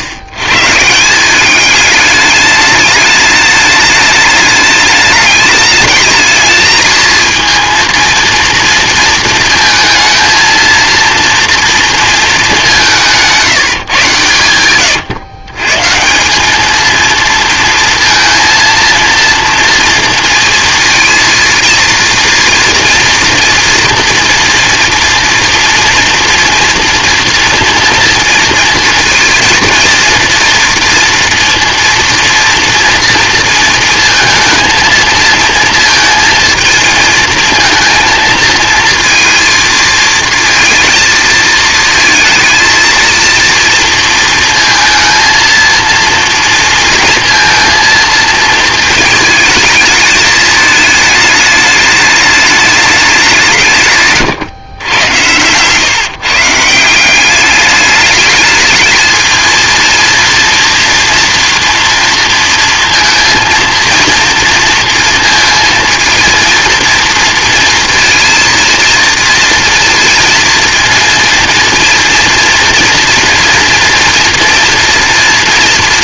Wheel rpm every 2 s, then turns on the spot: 100, 210, 210, 220, 230, 220, 200, 120, 210, 230, 230, 230, 240, 230, 230, 230, 230, 220, 230, 230, 230, 220, 230, 230, 220, 210, 210, 110, 150, 220, 230, 230, 230, 230, 230, 230, 230, 240.
14-16